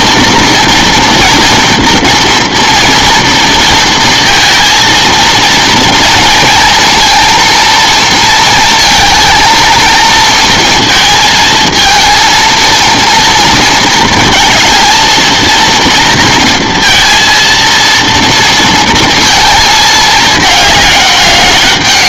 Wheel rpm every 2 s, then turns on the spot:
230, 240, 230, 230, 230, 230, 230, 230, 230, 230, 210.
none